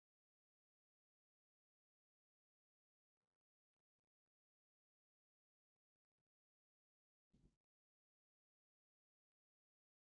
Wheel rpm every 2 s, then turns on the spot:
0, 0, 0, 0, 0.
none